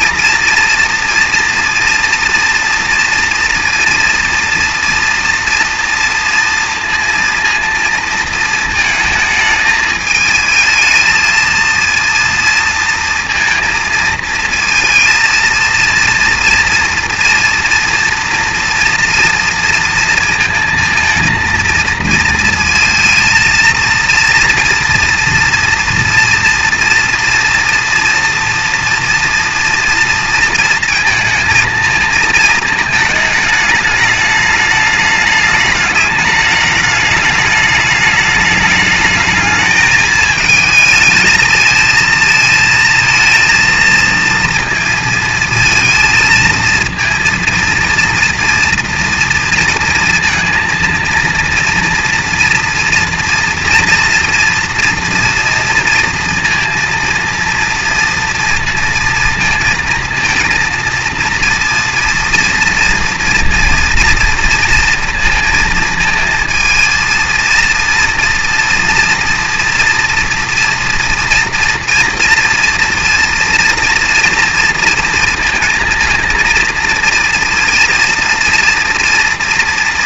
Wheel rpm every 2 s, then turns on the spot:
230, 230, 230, 230, 220, 220, 230, 220, 230, 230, 230, 230, 230, 230, 240, 230, 220, 210, 210, 210, 220, 220, 230, 230, 240, 230, 230, 230, 230, 230, 230, 230, 230, 230, 240, 240, 230, 230, 230, 230.
none